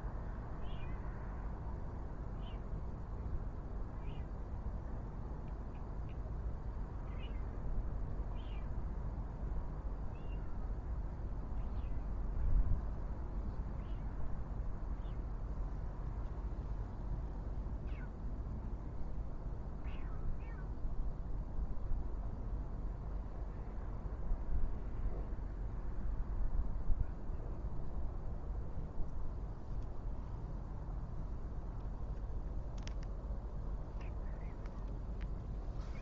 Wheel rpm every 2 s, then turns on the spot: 0, 0, 0, 0, 0, 0, 0, 0, 0, 0, 0, 0, 0, 0, 0, 0, 0, 0.
none